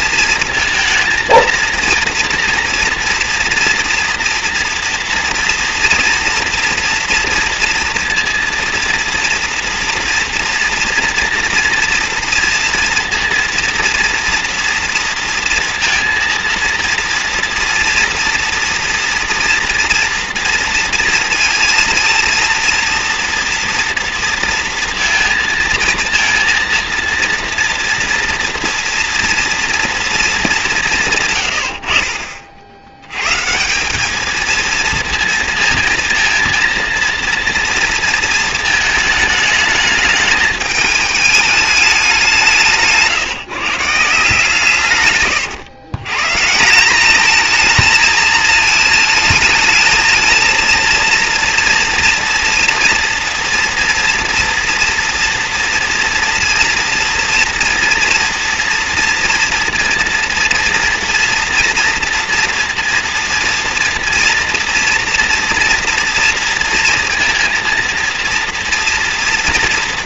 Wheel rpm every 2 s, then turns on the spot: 230, 230, 230, 230, 240, 240, 230, 230, 230, 230, 230, 230, 230, 230, 230, 190, 60, 230, 230, 230, 220, 170, 150, 170, 220, 220, 230, 240, 230, 230, 230, 230, 230, 230, 230.
none